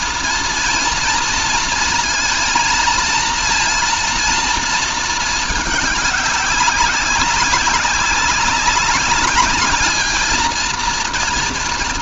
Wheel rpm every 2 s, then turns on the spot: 230, 230, 220, 190, 200, 230.
none